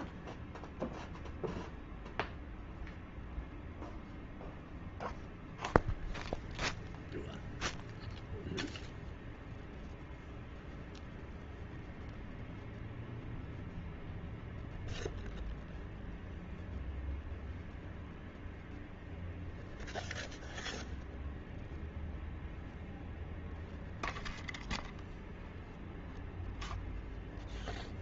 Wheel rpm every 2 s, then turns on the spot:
0, 0, 0, 0, 0, 0, 0, 0, 0, 0, 0, 0, 0, 0.
none